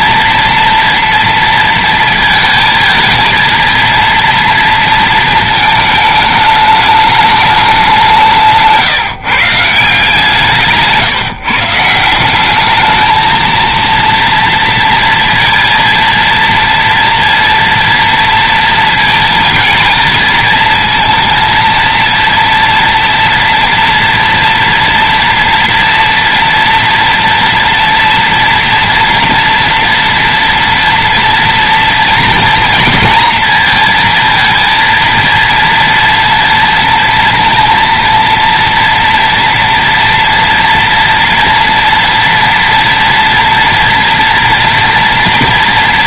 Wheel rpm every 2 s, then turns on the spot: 230, 230, 230, 210, 170, 160, 190, 230, 230, 230, 230, 230, 230, 230, 240, 230, 230, 230, 230, 230, 240, 230, 230.
none